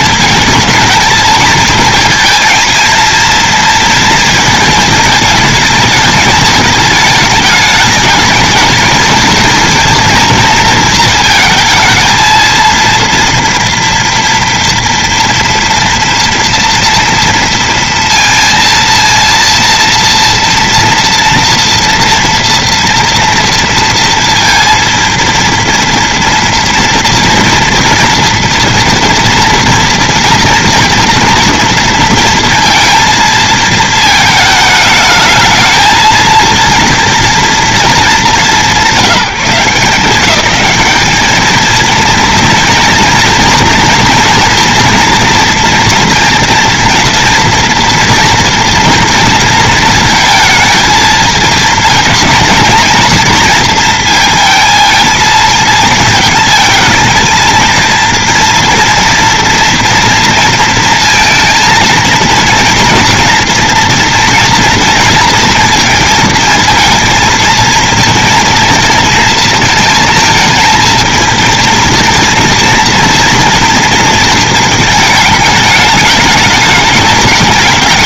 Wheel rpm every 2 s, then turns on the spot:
220, 230, 220, 210, 210, 230, 230, 230, 230, 230, 230, 240, 230, 240, 240, 230, 230, 220, 230, 190, 200, 230, 230, 230, 230, 230, 230, 230, 220, 230, 230, 230, 240, 230, 230, 220, 230, 220, 210.
none